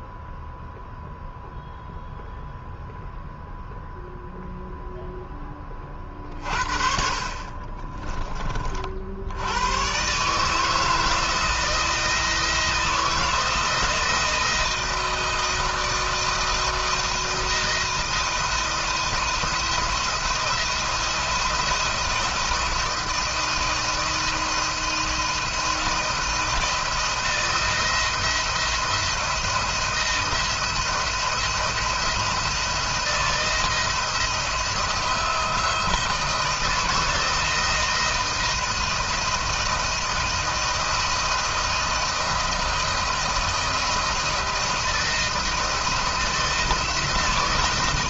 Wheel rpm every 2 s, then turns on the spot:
0, 0, 0, 40, 60, 160, 160, 160, 170, 170, 170, 170, 160, 170, 170, 170, 160, 170, 160, 160, 160, 160, 160, 160.
none